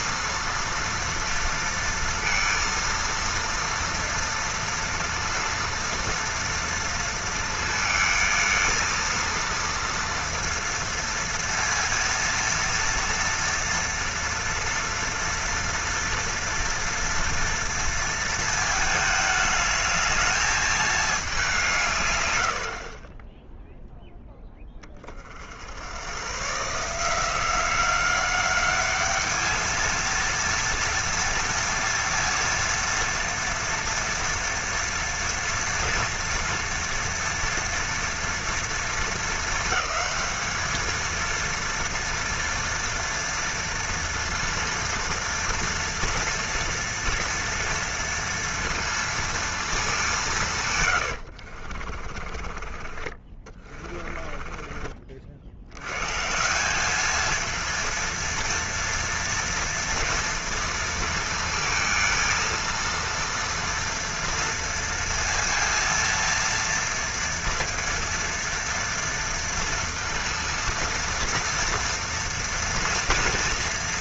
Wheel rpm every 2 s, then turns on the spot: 230, 230, 230, 230, 230, 230, 230, 240, 230, 220, 220, 60, 20, 150, 200, 230, 230, 230, 230, 230, 220, 230, 230, 230, 230, 130, 30, 30, 180, 230, 230, 230, 230, 230, 230, 230, 240.
52-56